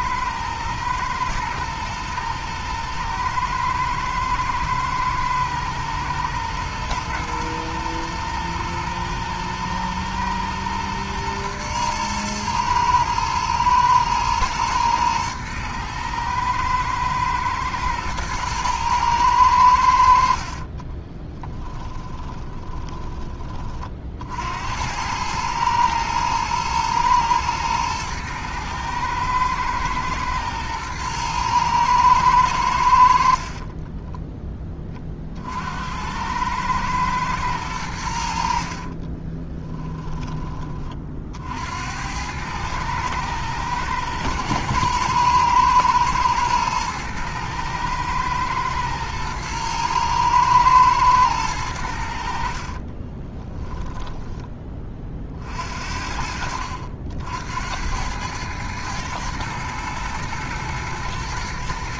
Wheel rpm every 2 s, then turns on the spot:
110, 110, 110, 110, 110, 120, 110, 110, 120, 110, 20, 20, 90, 110, 110, 120, 90, 20, 110, 40, 30, 110, 110, 110, 110, 110, 30, 30, 70, 110, 110.
20-22 38-40 52-54